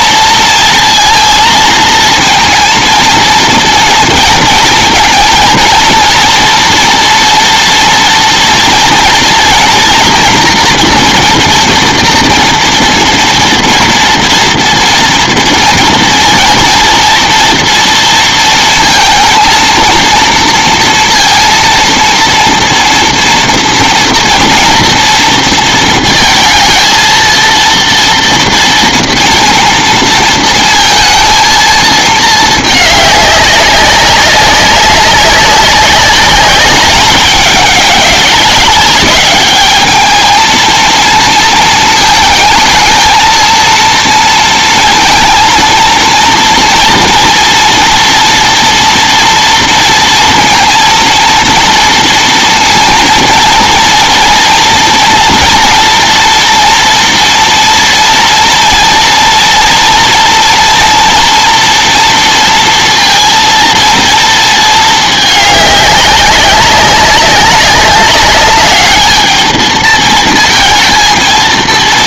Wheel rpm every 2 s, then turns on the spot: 230, 230, 230, 230, 230, 240, 230, 240, 230, 230, 230, 230, 230, 220, 230, 230, 210, 190, 210, 200, 230, 220, 230, 230, 230, 230, 230, 230, 230, 230, 230, 230, 220, 190, 210, 220.
none